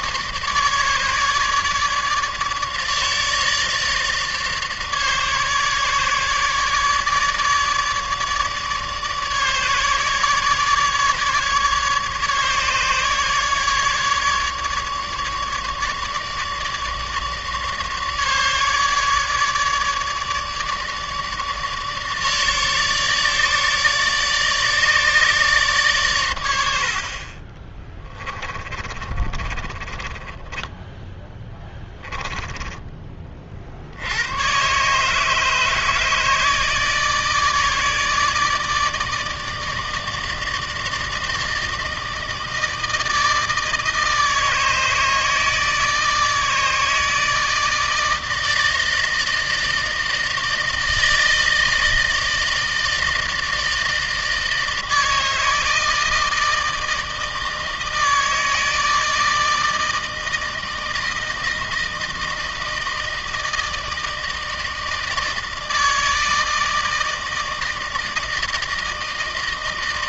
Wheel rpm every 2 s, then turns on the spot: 150, 150, 150, 150, 150, 150, 150, 150, 150, 150, 150, 150, 150, 70, 20, 10, 20, 120, 160, 150, 160, 160, 160, 160, 160, 160, 160, 160, 160, 160, 160, 160, 160, 160, 160.
26-34